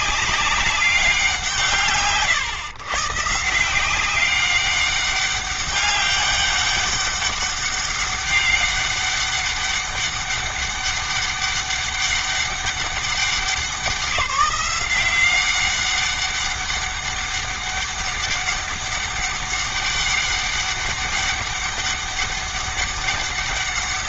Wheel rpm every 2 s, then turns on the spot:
190, 120, 190, 200, 200, 200, 200, 190, 200, 200, 200, 200.
none